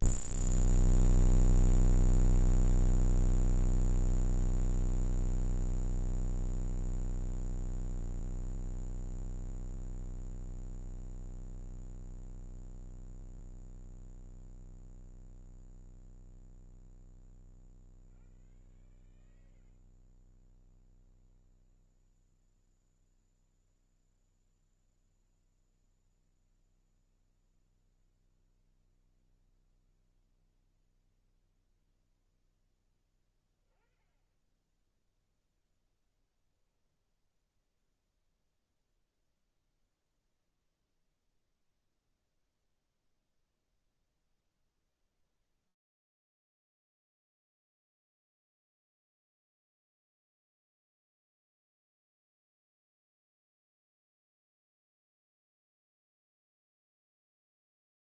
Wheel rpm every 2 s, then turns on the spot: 0, 0, 0, 0, 0, 0, 0, 0, 10, 100, 10, 0, 0, 0, 0, 0, 10, 10, 0, 0, 0, 0, 0, 0, 0, 0, 0, 0, 0.
20-22